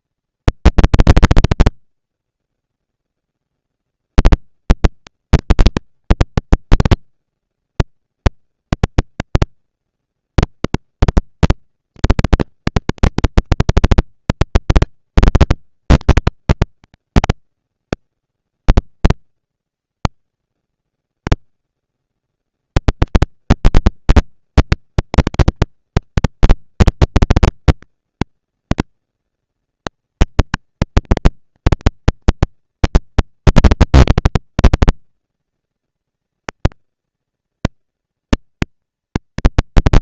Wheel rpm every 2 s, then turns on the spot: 240, 230, 240, 230, 230, 230, 230, 230, 210, 180, 90, 200, 230, 230, 230, 230, 230, 230, 230, 230.
none